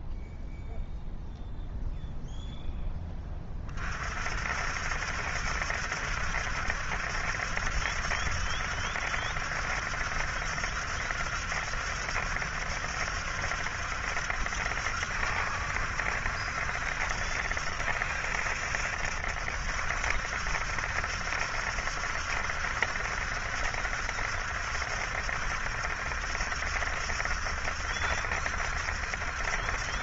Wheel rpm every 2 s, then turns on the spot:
0, 0, 60, 70, 70, 70, 70, 70, 70, 70, 70, 70, 70, 70, 70.
none